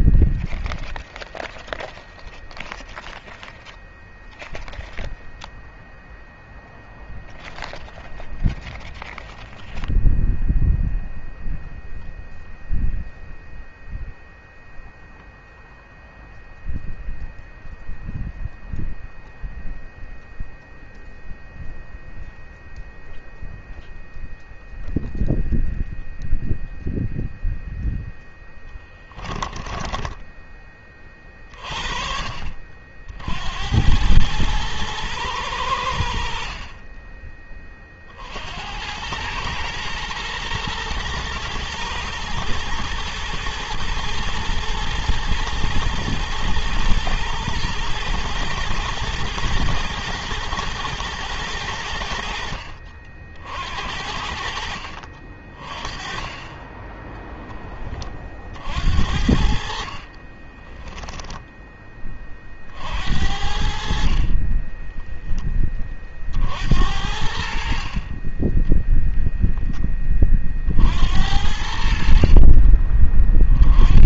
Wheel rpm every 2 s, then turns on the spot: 0, 0, 0, 0, 0, 0, 0, 0, 0, 0, 0, 0, 0, 0, 10, 20, 50, 110, 40, 80, 110, 110, 120, 110, 110, 110, 60, 60, 20, 60, 30, 50, 20, 70, 10, 50, 40.
28-30 60-62 64-66 68-70